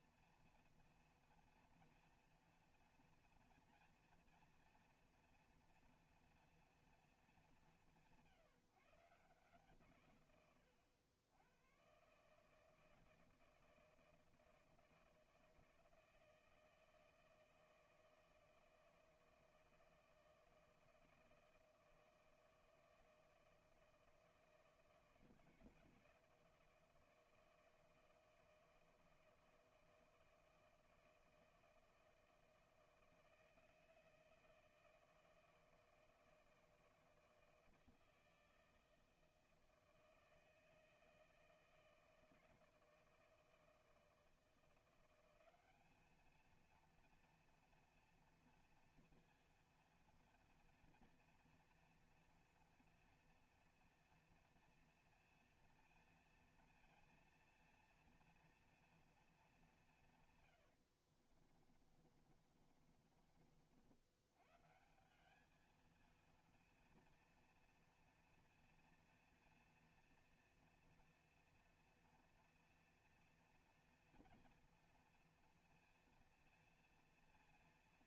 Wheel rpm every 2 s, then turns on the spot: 230, 230, 230, 230, 150, 120, 160, 160, 160, 160, 160, 160, 160, 160, 160, 160, 160, 160, 160, 160, 160, 160, 160, 230, 240, 230, 230, 230, 230, 230, 110, 40, 130, 230, 230, 230, 240, 230, 230.
60-64